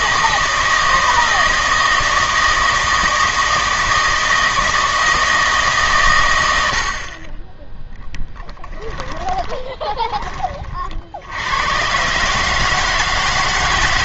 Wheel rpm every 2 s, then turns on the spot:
160, 160, 160, 70, 10, 40, 150.
6-10